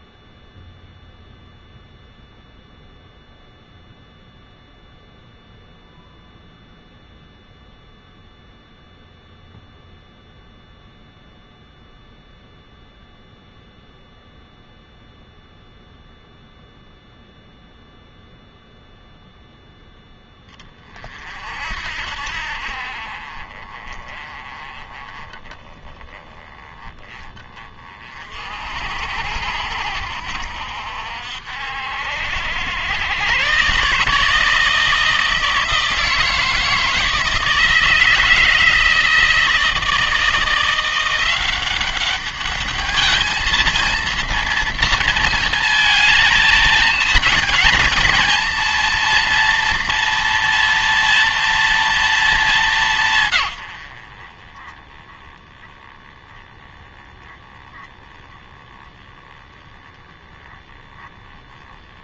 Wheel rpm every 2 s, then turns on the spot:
0, 0, 0, 0, 0, 0, 0, 0, 0, 0, 30, 50, 20, 20, 60, 60, 90, 160, 160, 160, 170, 210, 230, 220, 230, 230, 180, 10, 10, 10, 10.
none